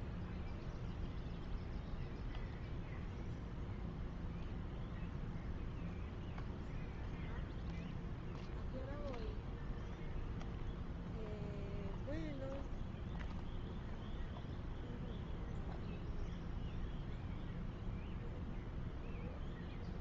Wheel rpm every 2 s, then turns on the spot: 0, 0, 0, 0, 0, 0, 0, 0, 0, 0.
none